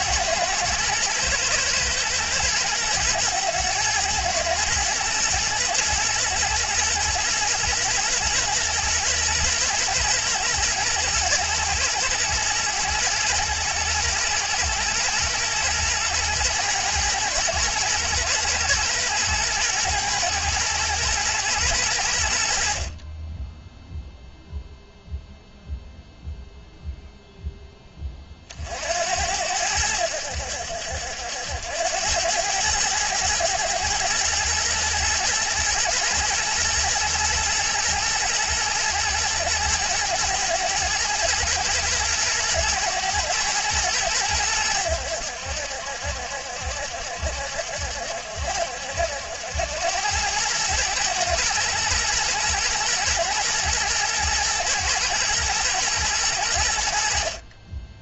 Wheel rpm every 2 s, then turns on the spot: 110, 110, 110, 110, 120, 120, 120, 110, 120, 120, 120, 50, 0, 0, 60, 70, 110, 110, 110, 110, 110, 110, 90, 70, 70, 110, 120, 120, 70.
none